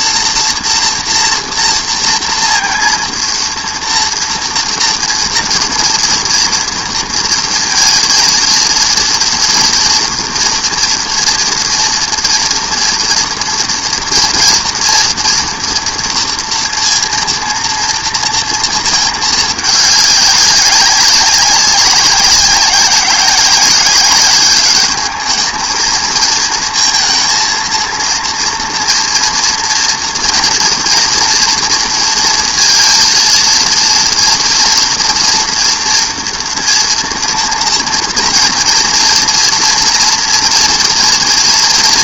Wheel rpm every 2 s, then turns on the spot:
240, 230, 230, 230, 230, 240, 240, 230, 240, 230, 200, 190, 200, 220, 230, 240, 230, 230, 230, 230, 230.
none